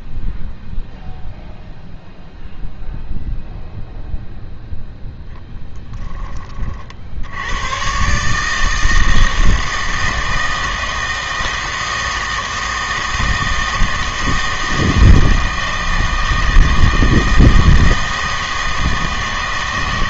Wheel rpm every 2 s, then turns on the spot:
0, 0, 0, 40, 160, 160, 160, 160, 160, 160.
none